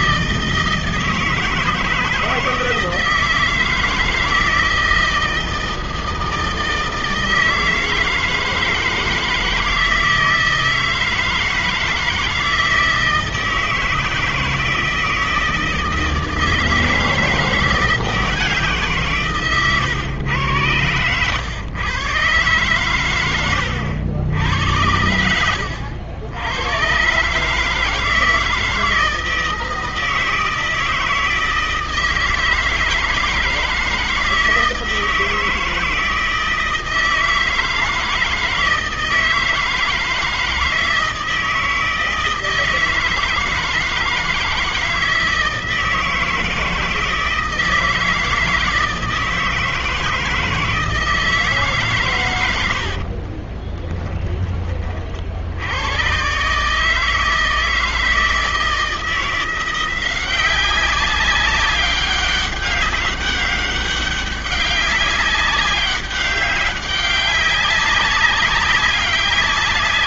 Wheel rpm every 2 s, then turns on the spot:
160, 160, 160, 160, 160, 160, 160, 160, 160, 170, 110, 130, 90, 100, 160, 160, 160, 160, 160, 160, 160, 160, 160, 160, 160, 160, 110, 20, 130, 160, 190, 200, 200, 200, 190.
52-54